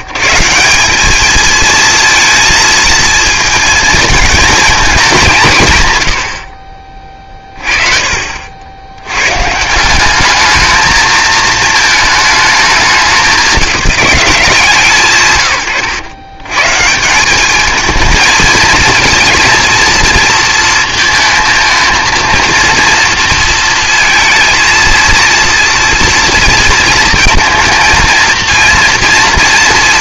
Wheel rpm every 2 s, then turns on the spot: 170, 220, 230, 50, 70, 220, 210, 170, 130, 220, 230, 230, 230, 230, 230.
none